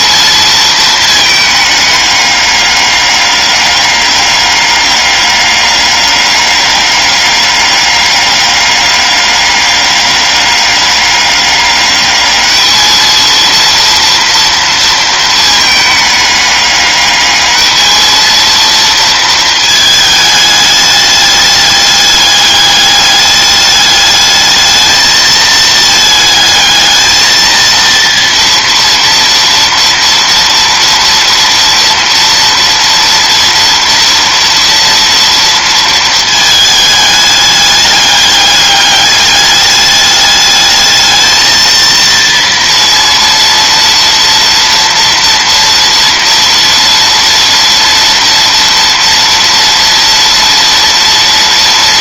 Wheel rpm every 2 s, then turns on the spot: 220, 200, 200, 200, 200, 200, 210, 230, 210, 230, 210, 200, 220, 220, 230, 230, 230, 230, 220, 200, 210, 230, 230, 230, 230, 230.
none